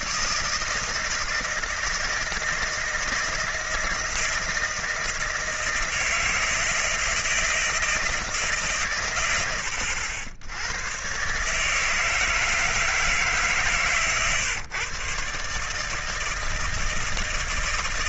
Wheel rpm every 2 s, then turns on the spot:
160, 160, 170, 160, 160, 90, 160, 130, 160.
none